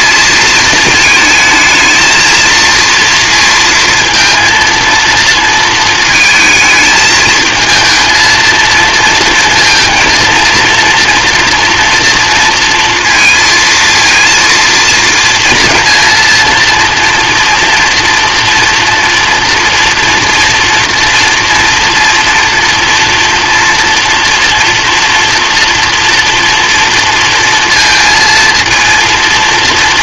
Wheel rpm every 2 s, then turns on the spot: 220, 230, 230, 220, 230, 230, 230, 230, 230, 230, 230, 230, 240, 230, 230.
none